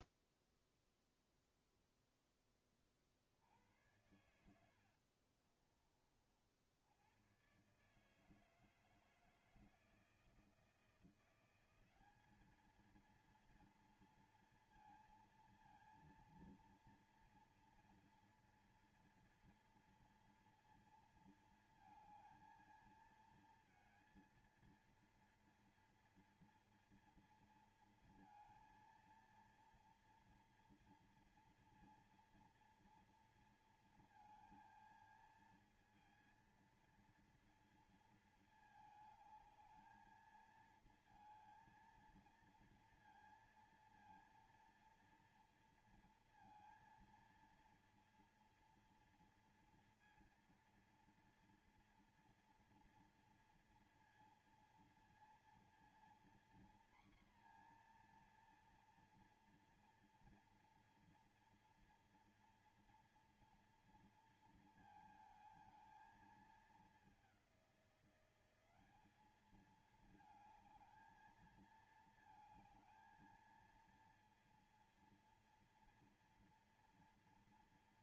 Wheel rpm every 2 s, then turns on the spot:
0, 40, 70, 90, 160, 170, 220, 230, 240, 230, 230, 220, 230, 230, 230, 230, 230, 230, 230, 220, 230, 230, 230, 230, 230, 230, 230, 230, 240, 240, 230, 230, 220, 200, 200, 220, 220, 230, 240.
4-6